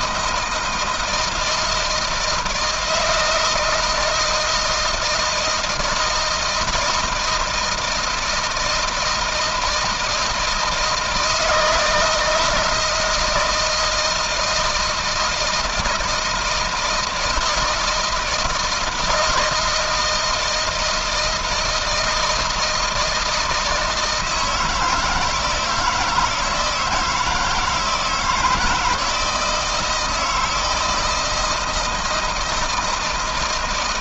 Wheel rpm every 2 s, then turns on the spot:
160, 160, 160, 160, 160, 160, 160, 160, 160, 170, 160, 160, 160, 160, 160, 160, 160.
none